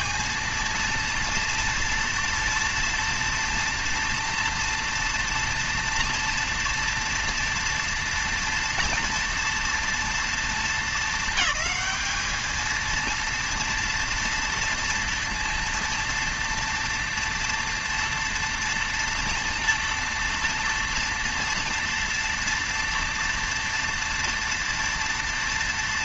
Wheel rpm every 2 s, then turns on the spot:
230, 230, 230, 230, 230, 230, 220, 230, 230, 230, 230, 230, 230.
none